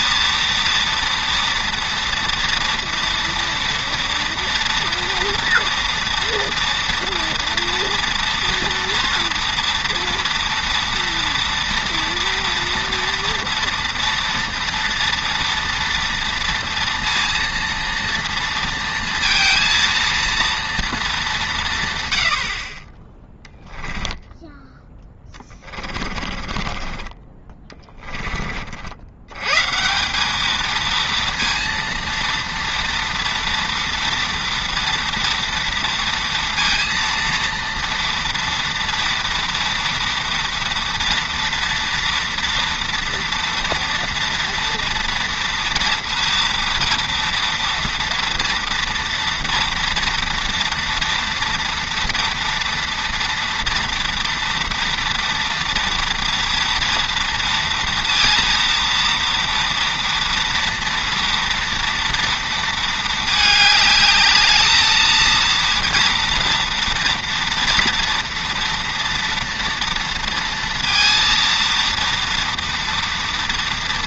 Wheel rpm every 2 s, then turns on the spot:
230, 230, 230, 230, 230, 230, 230, 240, 230, 230, 230, 50, 10, 20, 40, 220, 230, 230, 230, 230, 230, 230, 230, 230, 230, 230, 230, 230, 230, 230, 230, 230, 220, 230, 230, 230, 230.
26-28